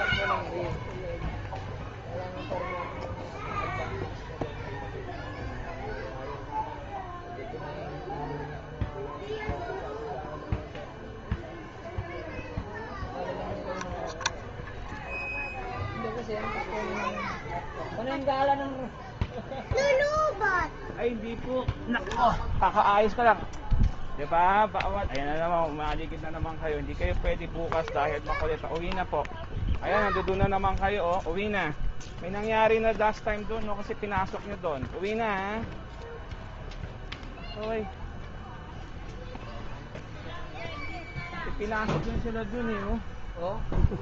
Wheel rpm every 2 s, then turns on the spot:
0, 0, 0, 0, 0, 0, 0, 0, 0, 0, 0, 0, 0, 0, 0, 0, 0, 0, 0, 0, 0, 0.
none